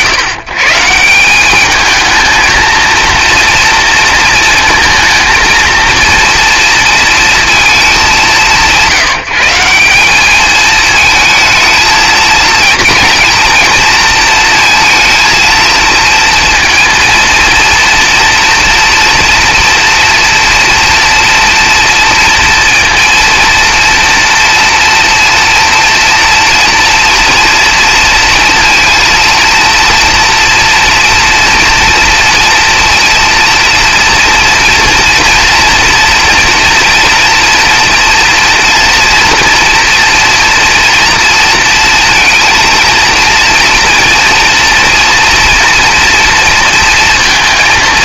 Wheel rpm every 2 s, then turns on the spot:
130, 230, 230, 230, 120, 220, 230, 230, 230, 240, 230, 230, 230, 230, 230, 230, 230, 240, 230, 240, 230, 230, 230, 230.
none